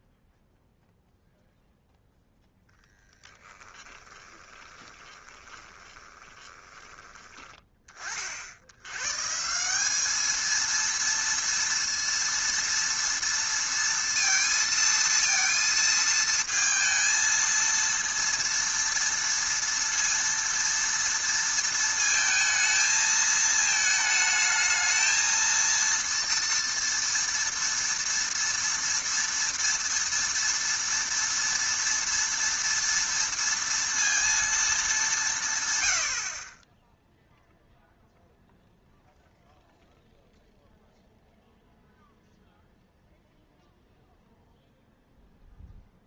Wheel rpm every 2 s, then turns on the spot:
0, 0, 20, 20, 70, 230, 230, 230, 220, 230, 230, 220, 220, 230, 230, 230, 230, 220, 30, 0, 0, 0, 0.
4-8